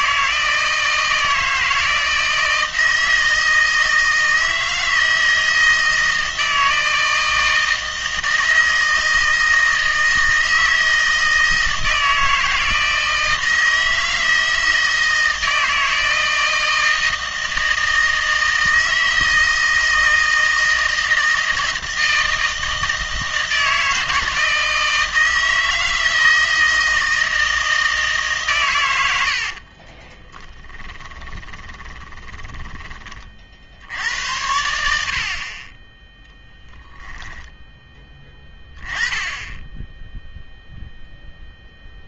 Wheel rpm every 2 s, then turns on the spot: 160, 160, 160, 160, 160, 160, 160, 160, 160, 160, 160, 160, 160, 160, 120, 10, 10, 80, 10, 10, 0.
30-32 36-38